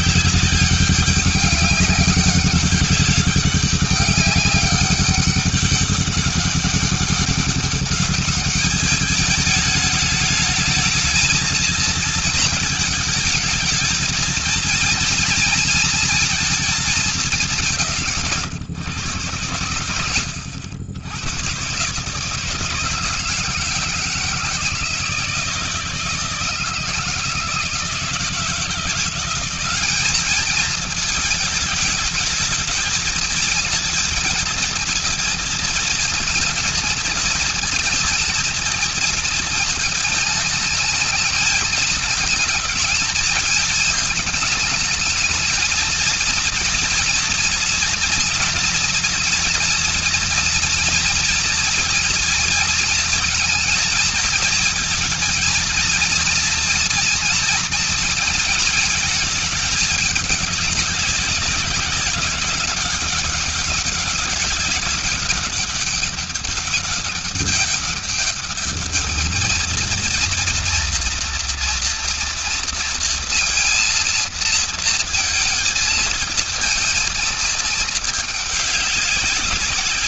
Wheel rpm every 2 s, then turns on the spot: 200, 200, 190, 200, 210, 220, 210, 230, 180, 100, 100, 160, 160, 170, 180, 210, 220, 230, 230, 220, 220, 220, 220, 230, 230, 230, 230, 230, 230, 220, 200, 200, 200, 200, 210, 230, 230, 230, 220, 200.
none